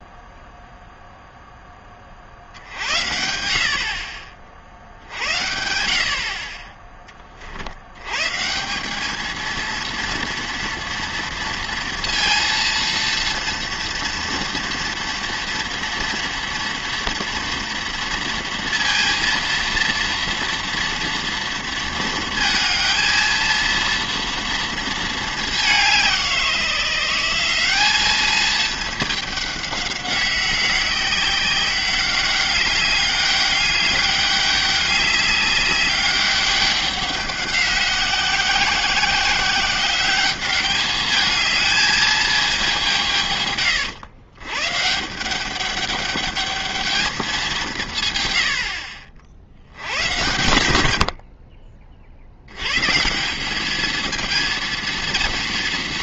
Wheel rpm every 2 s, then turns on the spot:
0, 70, 60, 20, 190, 230, 230, 230, 230, 230, 230, 230, 230, 170, 210, 190, 200, 200, 200, 180, 210, 190, 140, 220, 70, 100, 120, 230.
none